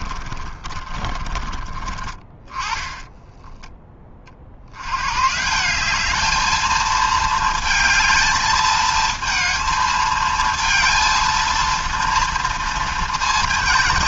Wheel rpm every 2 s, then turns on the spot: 30, 30, 70, 220, 220, 230, 230.
0-4